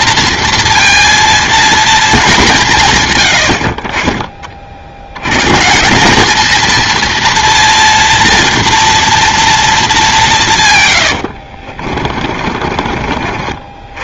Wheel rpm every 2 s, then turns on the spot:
230, 160, 40, 220, 230, 130, 40.
12-14